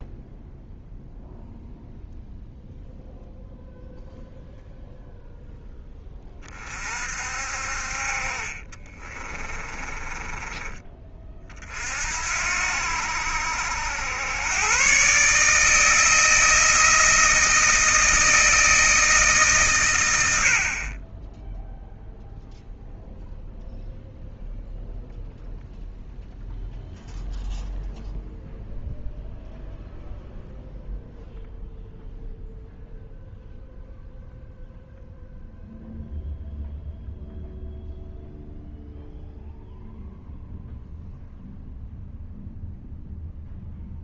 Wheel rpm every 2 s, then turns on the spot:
0, 0, 0, 40, 30, 20, 70, 130, 160, 160, 30, 0, 0, 0, 0, 0, 0, 0, 0, 0, 0, 0.
8-10